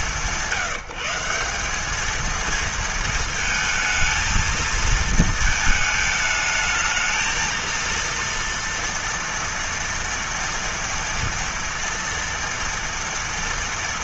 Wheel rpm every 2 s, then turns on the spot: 170, 230, 230, 220, 230, 230, 230.
none